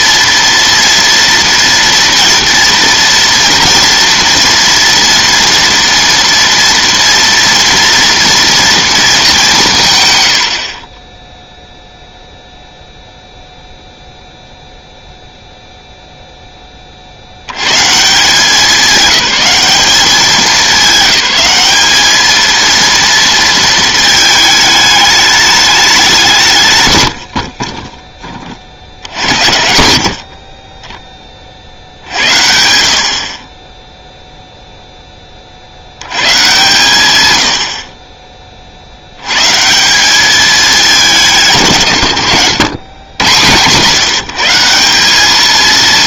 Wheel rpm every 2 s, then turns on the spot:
230, 230, 230, 230, 230, 60, 0, 0, 20, 200, 200, 230, 210, 140, 50, 30, 70, 0, 130, 30, 210, 100, 180.
none